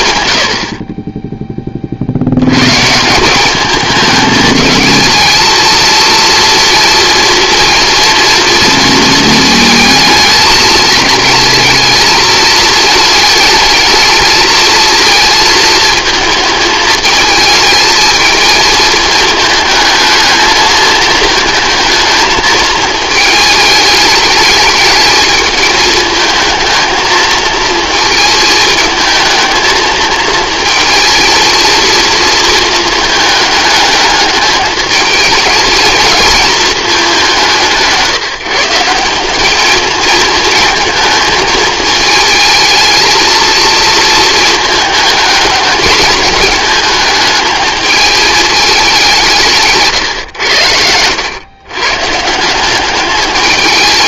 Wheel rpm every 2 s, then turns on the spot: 20, 150, 220, 230, 230, 220, 220, 220, 220, 220, 220, 220, 210, 220, 220, 230, 220, 220, 210, 180, 220, 220, 220, 220, 190, 90, 190.
none